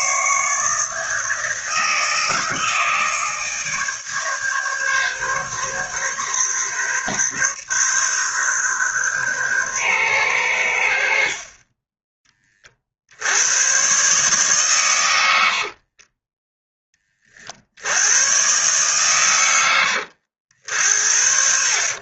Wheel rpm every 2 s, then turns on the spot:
150, 160, 140, 140, 130, 90, 30, 130, 10, 120, 80.
none